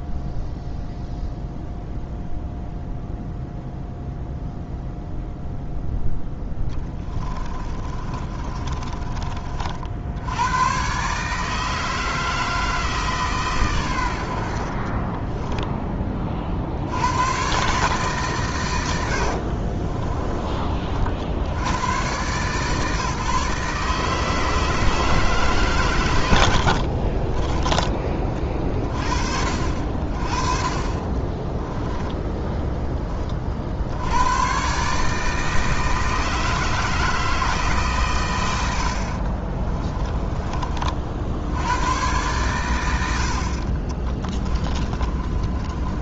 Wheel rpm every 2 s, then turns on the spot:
0, 0, 0, 20, 30, 130, 160, 30, 90, 80, 40, 150, 160, 50, 40, 30, 10, 140, 160, 60, 50, 90, 30.
6-10 14-16 26-28 30-32 44-46